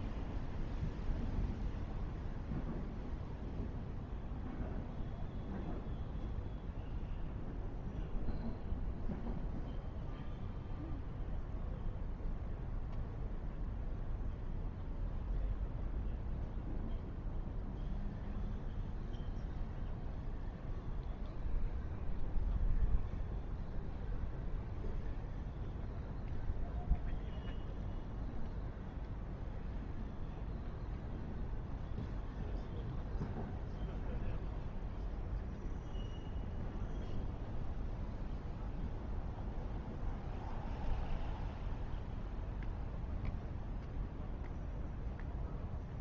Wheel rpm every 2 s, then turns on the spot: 0, 0, 0, 0, 0, 0, 0, 0, 0, 0, 0, 0, 0, 0, 0, 0, 0, 0, 0, 0, 0, 0, 0.
none